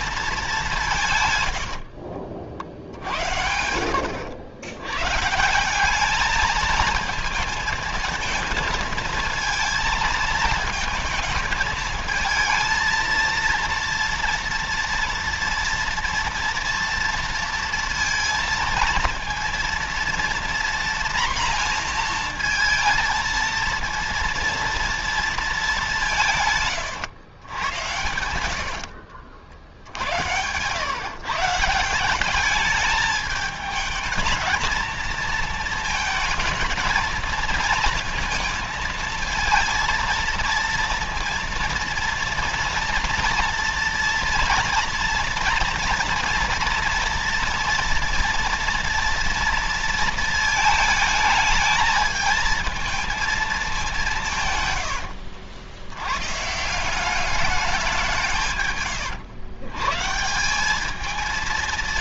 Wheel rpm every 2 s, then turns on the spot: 200, 70, 110, 220, 220, 220, 220, 230, 230, 230, 240, 230, 230, 160, 90, 110, 200, 230, 230, 230, 230, 230, 230, 230, 230, 220, 220, 140, 140, 140, 180.
28-30